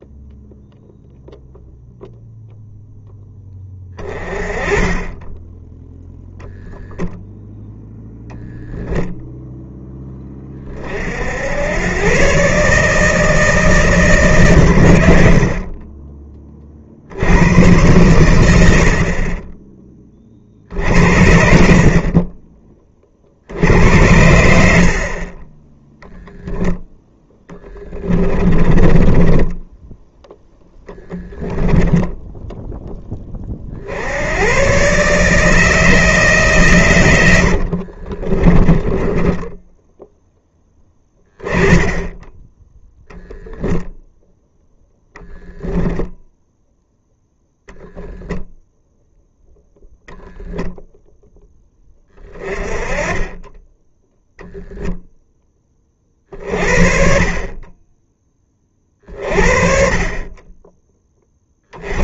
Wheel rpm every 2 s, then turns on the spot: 0, 0, 20, 0, 0, 40, 150, 100, 50, 60, 60, 30, 60, 20, 20, 10, 10, 130, 120, 20, 10, 0, 0, 10, 0, 0, 30, 0, 40, 30, 10.
28-30 38-40